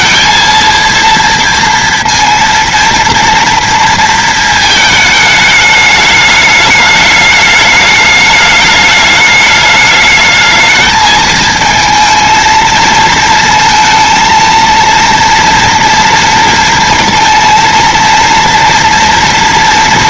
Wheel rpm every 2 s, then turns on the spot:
230, 230, 220, 210, 210, 220, 230, 230, 230, 230.
none